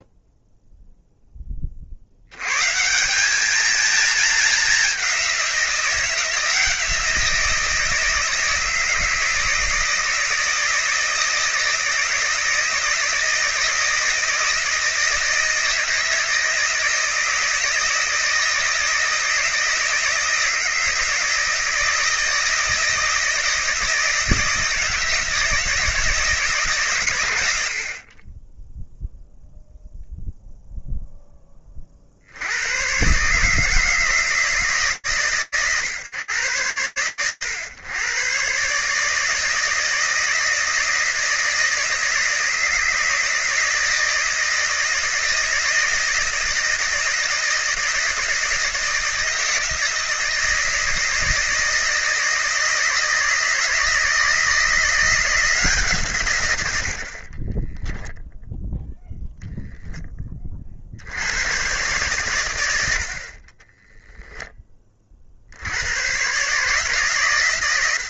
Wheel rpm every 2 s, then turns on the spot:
0, 130, 200, 170, 160, 160, 160, 160, 160, 160, 170, 160, 160, 140, 0, 0, 90, 150, 120, 140, 160, 160, 160, 160, 160, 160, 160, 170, 100, 0, 60, 60, 40, 120.
none